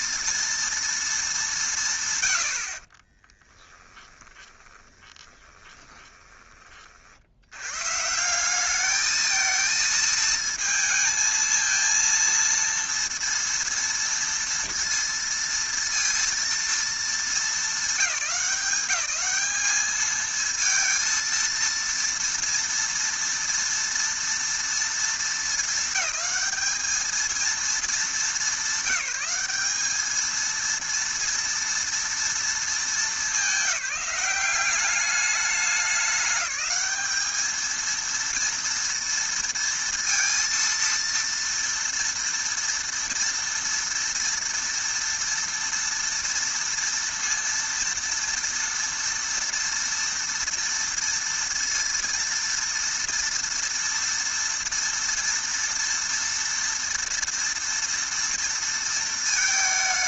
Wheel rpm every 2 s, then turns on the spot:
230, 90, 10, 20, 190, 220, 230, 230, 230, 180, 220, 230, 230, 220, 210, 220, 230, 200, 190, 230, 230, 230, 230, 230, 230, 230, 230, 230, 230, 230.
4-6